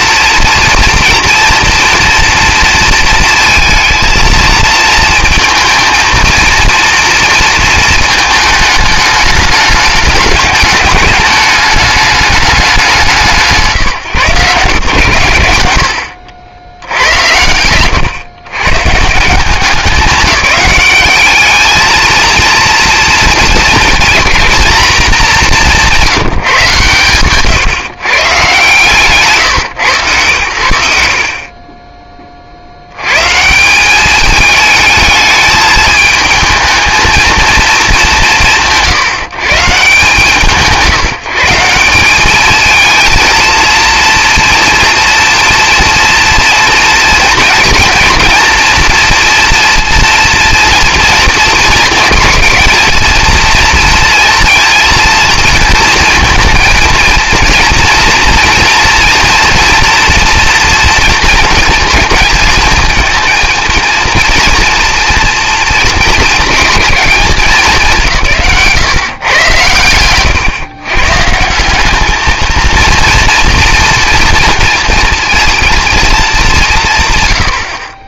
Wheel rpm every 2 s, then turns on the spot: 240, 230, 220, 230, 210, 210, 130, 90, 100, 170, 210, 230, 210, 130, 140, 30, 130, 220, 220, 130, 160, 230, 240, 230, 230, 230, 230, 230, 230, 240, 240, 230, 230, 210, 130, 140, 230, 230, 140.
none